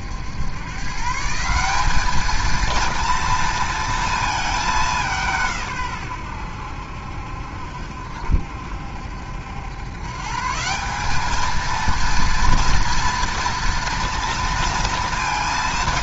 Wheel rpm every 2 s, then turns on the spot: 100, 220, 220, 100, 70, 150, 230, 230.
none